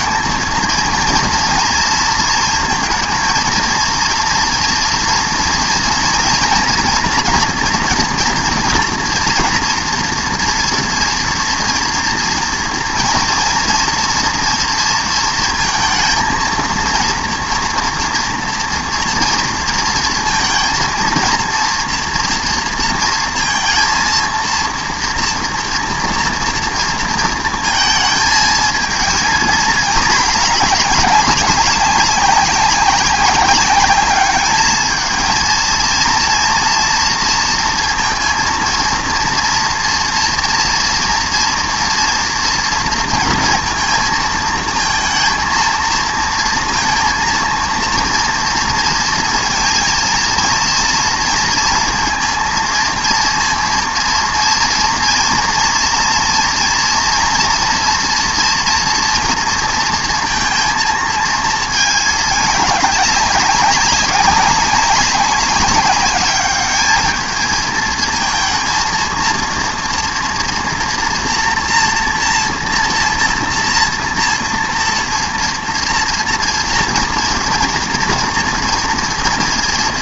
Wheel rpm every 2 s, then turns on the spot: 230, 230, 230, 230, 230, 240, 230, 230, 230, 230, 230, 230, 230, 230, 230, 210, 200, 210, 230, 230, 230, 230, 220, 230, 230, 230, 230, 230, 230, 240, 220, 210, 200, 210, 230, 230, 230, 230, 230, 230.
none